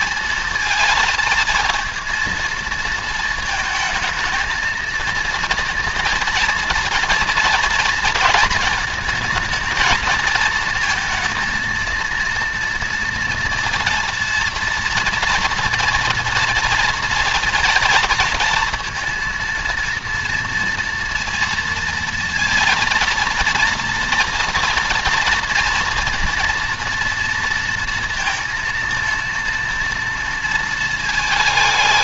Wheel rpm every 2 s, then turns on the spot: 230, 230, 230, 230, 220, 230, 230, 230, 230, 230, 230, 230, 230, 230, 230, 220.
none